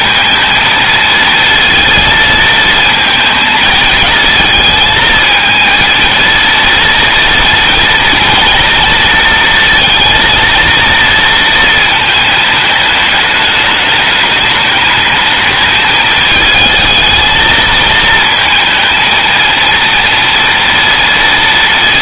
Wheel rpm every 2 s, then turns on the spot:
230, 230, 220, 230, 230, 230, 210, 220, 220, 220, 230.
none